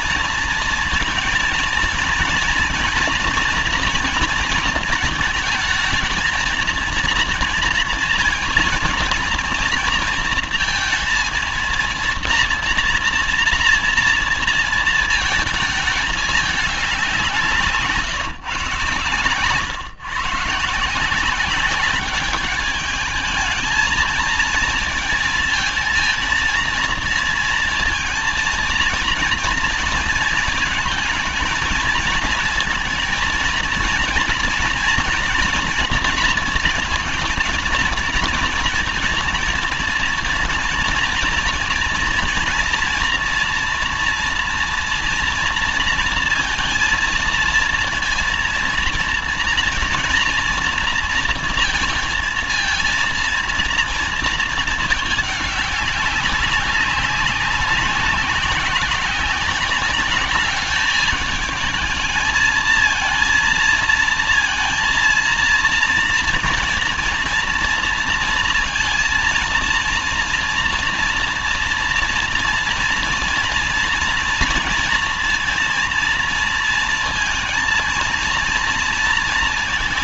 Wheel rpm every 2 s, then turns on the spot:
230, 230, 220, 230, 230, 230, 230, 220, 160, 130, 200, 220, 230, 230, 230, 230, 230, 230, 220, 230, 240, 240, 230, 230, 230, 230, 230, 200, 190, 190, 210, 230, 230, 230, 230, 230, 230, 230, 230, 230.
none